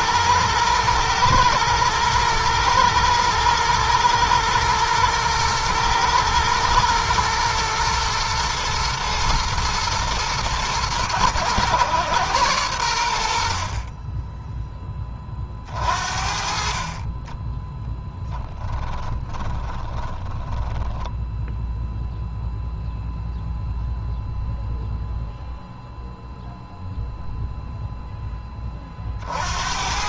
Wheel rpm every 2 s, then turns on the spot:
110, 110, 110, 120, 120, 110, 100, 20, 30, 10, 10, 0, 0, 0, 20.
18-22